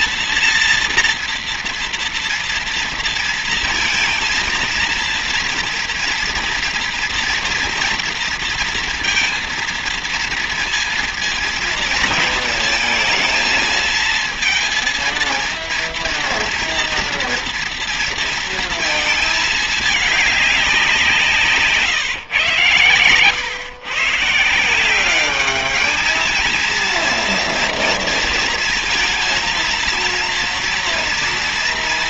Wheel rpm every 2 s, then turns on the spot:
230, 230, 230, 230, 230, 230, 230, 230, 230, 230, 200, 130, 160, 230, 230, 230.
none